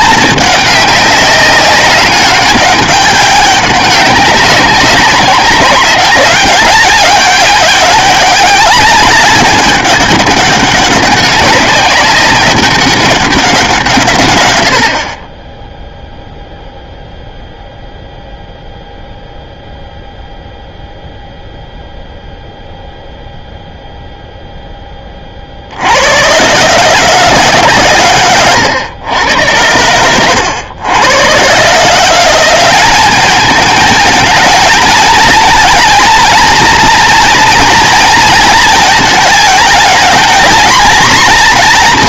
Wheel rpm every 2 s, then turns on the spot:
200, 190, 190, 210, 200, 200, 200, 40, 0, 0, 0, 0, 10, 140, 120, 100, 200, 220, 240, 220, 230.
none